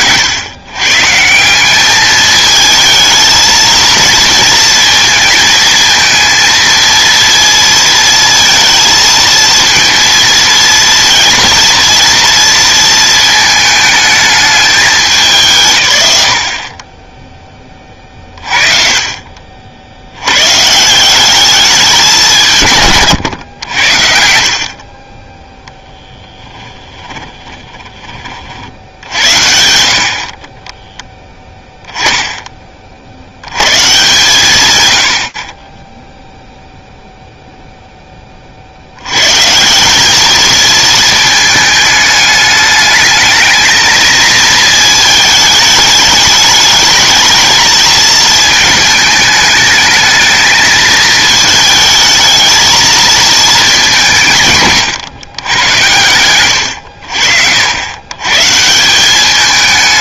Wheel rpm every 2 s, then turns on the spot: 120, 220, 230, 230, 230, 230, 230, 200, 40, 40, 150, 150, 40, 10, 60, 20, 30, 130, 0, 70, 220, 210, 220, 210, 220, 220, 220, 140, 100, 170.
26-28